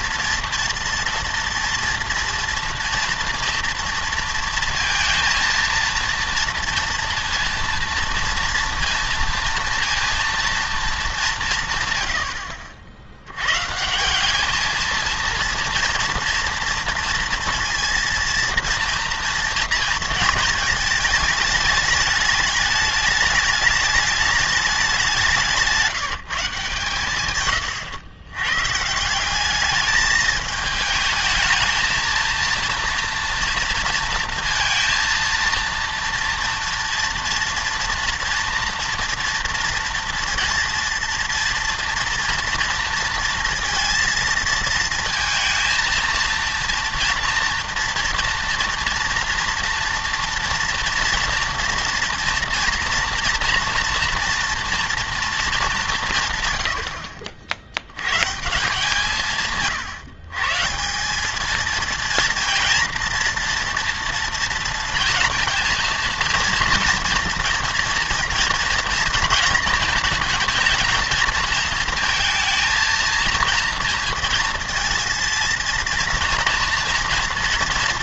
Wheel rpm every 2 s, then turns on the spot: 240, 230, 230, 230, 230, 230, 60, 210, 240, 230, 230, 210, 210, 160, 140, 220, 230, 230, 240, 230, 230, 230, 230, 230, 230, 230, 230, 240, 110, 160, 160, 230, 230, 230, 230, 230, 230, 230, 230.
none